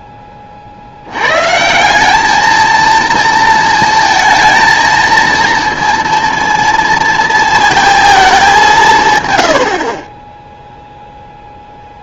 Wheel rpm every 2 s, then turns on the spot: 50, 220, 230, 230, 210, 0.
none